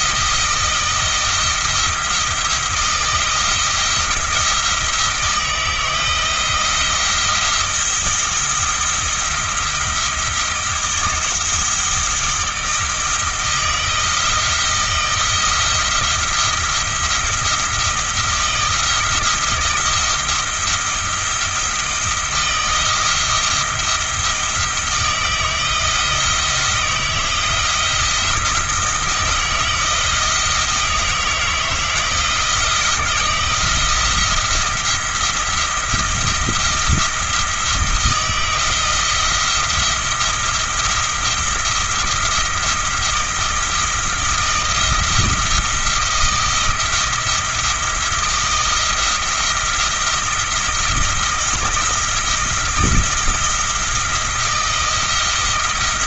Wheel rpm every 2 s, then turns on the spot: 170, 170, 170, 170, 170, 170, 160, 160, 170, 160, 170, 170, 160, 170, 160, 160, 170, 170, 170, 170, 170, 170, 160, 170, 170, 170, 170, 170.
none